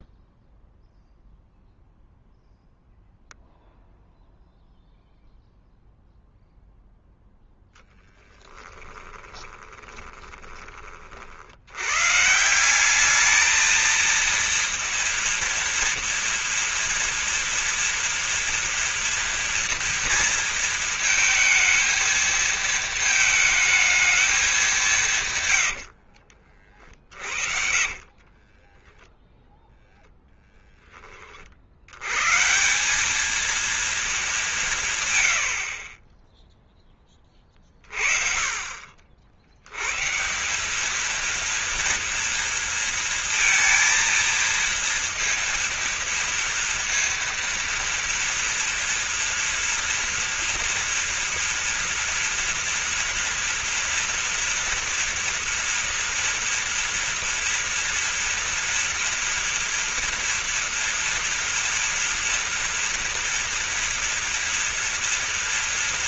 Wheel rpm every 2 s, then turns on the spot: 0, 0, 0, 0, 10, 30, 180, 230, 230, 240, 230, 220, 200, 50, 20, 10, 180, 180, 10, 40, 200, 230, 230, 230, 230, 230, 230, 240, 230, 230, 230, 230, 230.
8-10 26-30